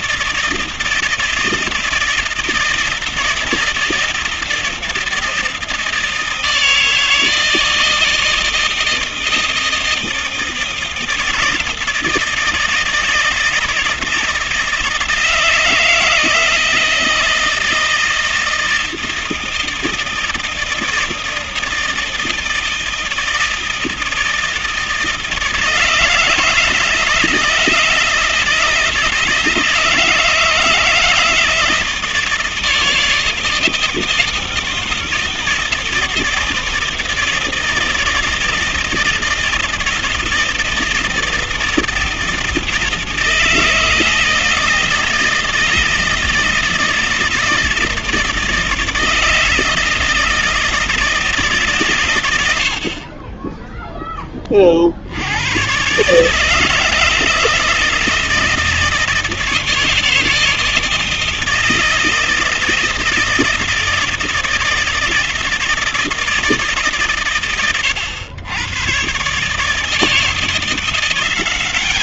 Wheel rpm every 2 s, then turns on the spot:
160, 160, 160, 160, 160, 160, 160, 160, 160, 160, 160, 170, 160, 150, 160, 160, 160, 160, 160, 160, 160, 160, 160, 160, 160, 160, 80, 40, 150, 160, 160, 160, 160, 110, 100, 170.
none